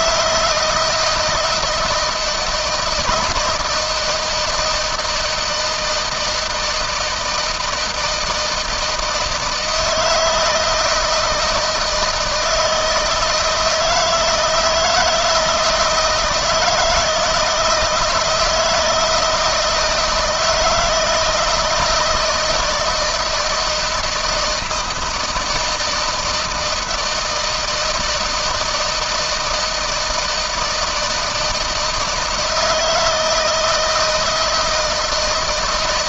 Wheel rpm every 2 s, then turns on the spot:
160, 170, 160, 160, 160, 160, 160, 160, 160, 160, 160, 160, 160, 160, 160, 160, 160, 160.
none